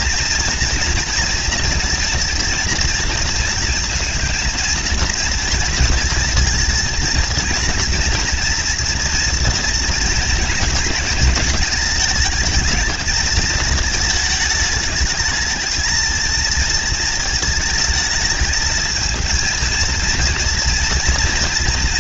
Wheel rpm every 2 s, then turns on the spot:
230, 230, 220, 230, 230, 230, 220, 220, 230, 220, 230.
none